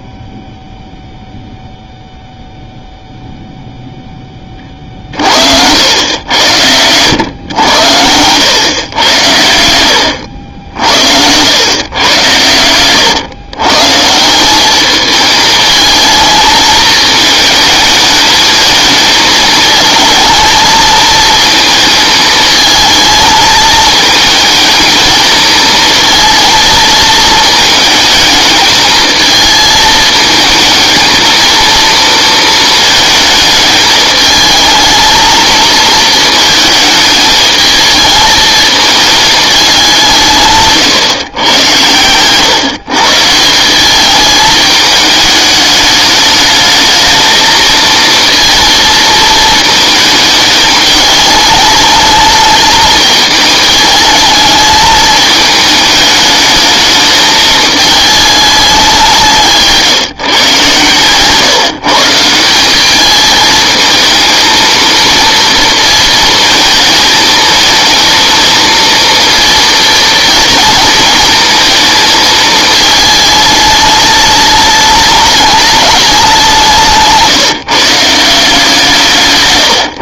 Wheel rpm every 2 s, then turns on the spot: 0, 0, 20, 100, 100, 80, 110, 170, 220, 220, 230, 220, 230, 230, 210, 220, 230, 220, 220, 220, 160, 120, 210, 210, 230, 220, 210, 220, 210, 210, 140, 180, 230, 230, 230, 230, 220, 210, 190, 170.
none